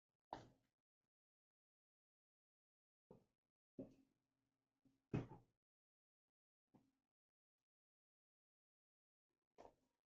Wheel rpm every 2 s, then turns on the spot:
0, 0, 0, 0, 0.
none